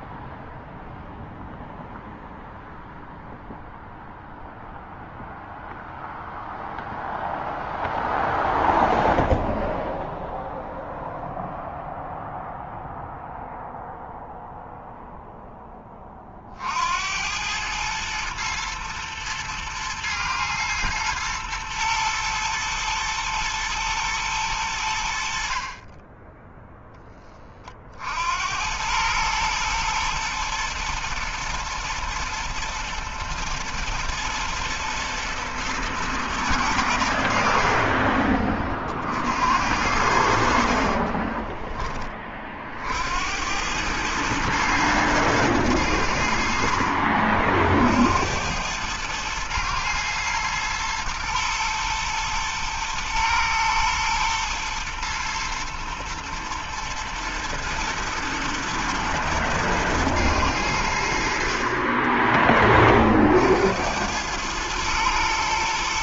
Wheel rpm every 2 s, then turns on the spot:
0, 0, 0, 0, 0, 0, 0, 0, 90, 110, 120, 110, 70, 10, 110, 120, 120, 120, 70, 60, 30, 70, 110, 50, 110, 120, 110, 110, 110, 120, 70, 40, 120.
40-42